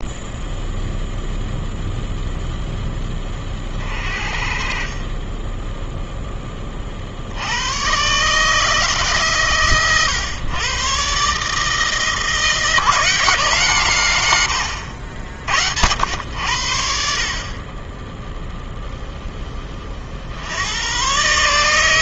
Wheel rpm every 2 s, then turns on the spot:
0, 0, 30, 40, 150, 130, 160, 80, 70, 0, 100.
none